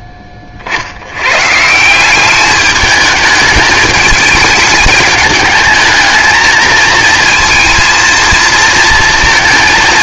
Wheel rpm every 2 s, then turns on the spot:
50, 210, 210, 220, 230.
none